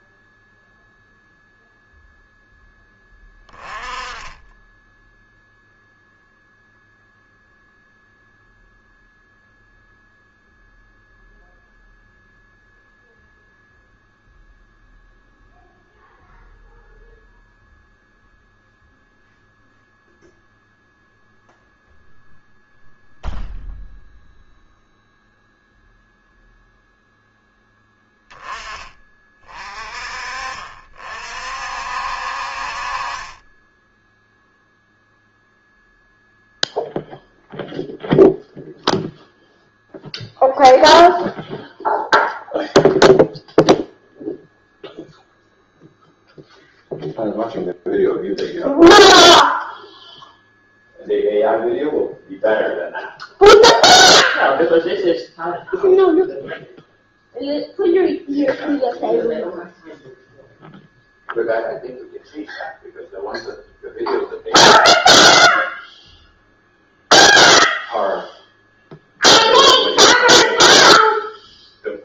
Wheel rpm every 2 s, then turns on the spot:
0, 10, 10, 0, 0, 0, 0, 0, 0, 0, 0, 0, 0, 0, 20, 40, 40, 0, 0, 0, 0, 0, 0, 0, 0, 0, 0, 0, 0, 0, 0, 0, 0, 0, 0, 0.
4-6